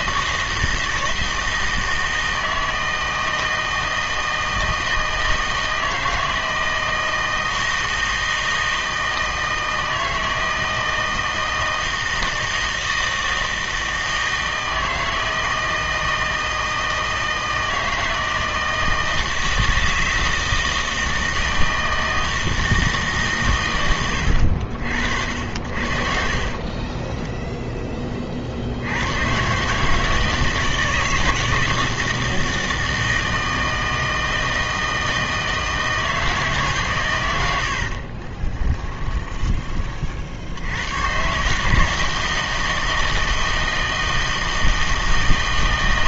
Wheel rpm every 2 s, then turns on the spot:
160, 160, 160, 160, 160, 160, 160, 160, 160, 160, 160, 160, 80, 30, 70, 160, 160, 160, 150, 20, 80, 160, 160.
26-28 38-40